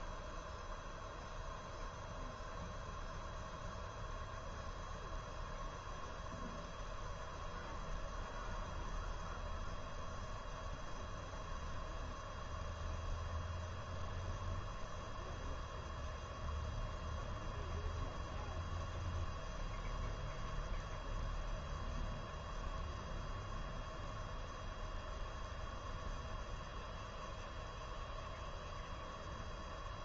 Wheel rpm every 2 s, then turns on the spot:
0, 0, 0, 0, 0, 0, 0, 0, 0, 0, 0, 0, 0, 0, 0.
none